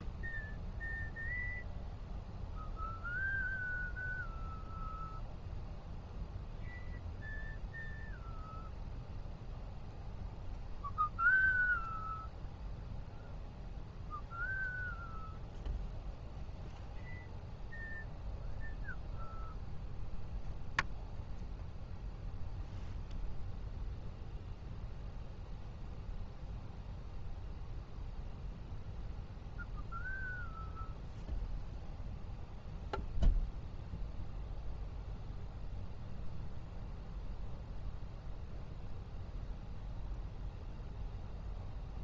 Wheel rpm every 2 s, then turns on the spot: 0, 0, 0, 0, 0, 0, 0, 0, 0, 0, 0, 0, 0, 0, 0, 0, 0, 0, 0, 0, 0.
none